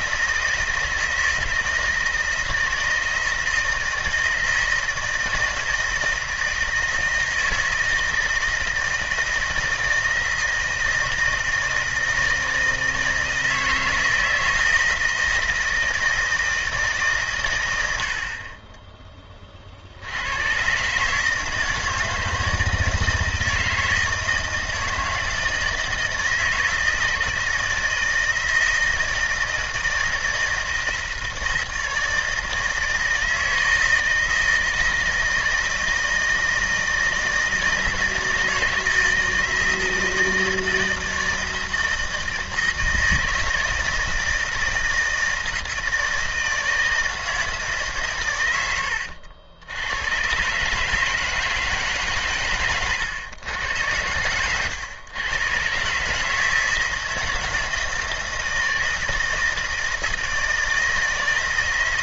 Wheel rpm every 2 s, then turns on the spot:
170, 160, 160, 160, 160, 160, 160, 160, 150, 20, 140, 160, 160, 160, 160, 160, 160, 160, 160, 160, 160, 160, 160, 160, 80, 150, 120, 110, 160, 160, 160.
none